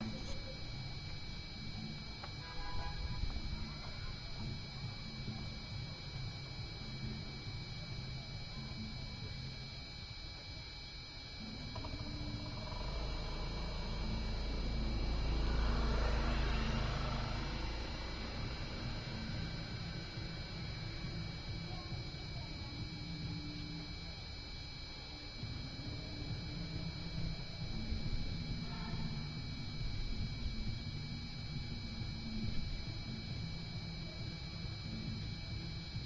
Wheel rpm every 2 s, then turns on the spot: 0, 0, 0, 0, 0, 0, 0, 0, 0, 0, 0, 0, 0, 0, 0, 0, 0, 0.
none